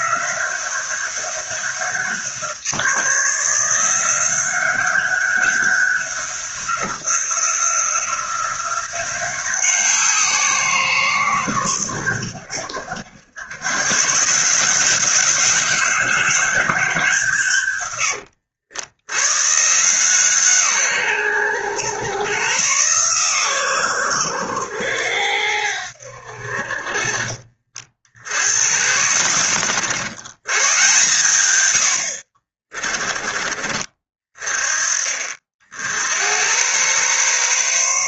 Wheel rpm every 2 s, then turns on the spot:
190, 170, 190, 190, 180, 170, 80, 160, 190, 80, 140, 120, 100, 50, 80, 110, 40, 30, 110.
32-34